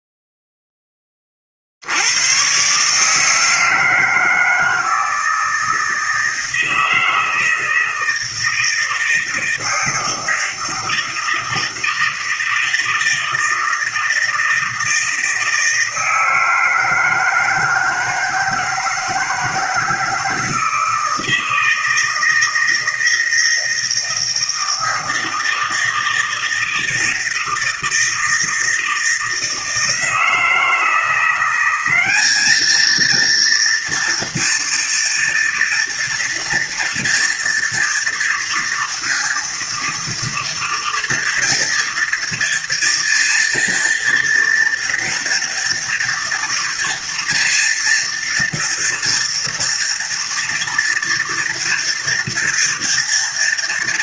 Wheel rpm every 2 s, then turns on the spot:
0, 120, 160, 160, 160, 160, 160, 160, 160, 160, 160, 160, 160, 160, 160, 160, 210, 230, 230, 230, 230, 230, 230, 230, 230, 230, 230.
none